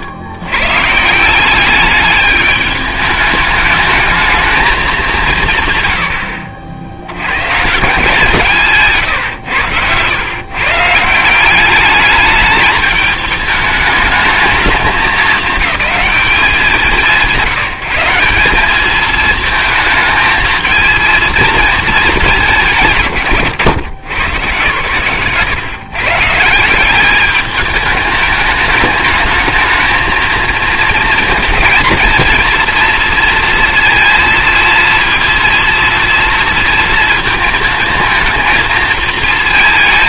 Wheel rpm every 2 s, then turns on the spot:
110, 210, 210, 60, 160, 140, 210, 220, 180, 220, 220, 170, 120, 160, 210, 230, 230, 230, 230, 220.
none